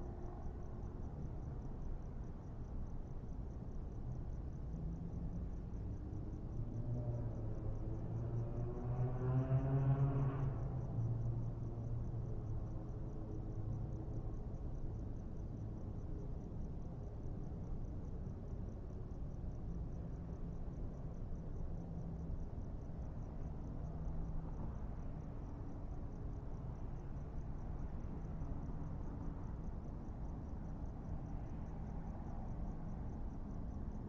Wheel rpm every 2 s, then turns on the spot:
0, 0, 0, 0, 0, 0, 0, 0, 0, 0, 0, 0, 0, 0, 0, 0, 0.
none